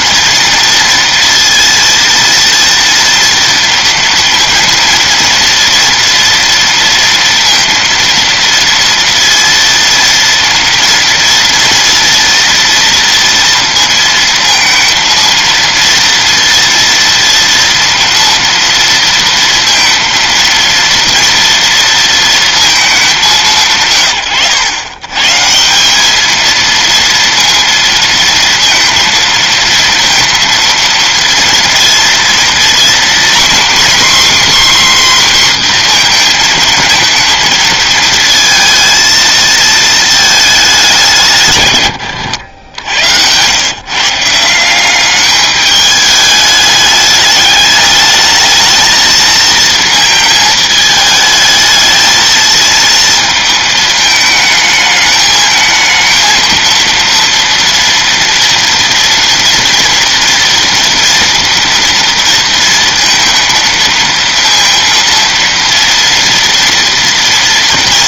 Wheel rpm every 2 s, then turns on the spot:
230, 230, 230, 230, 230, 240, 220, 230, 230, 230, 230, 130, 200, 230, 230, 230, 270, 240, 230, 220, 90, 150, 210, 210, 230, 220, 220, 220, 230, 240, 230, 230, 230, 230.
none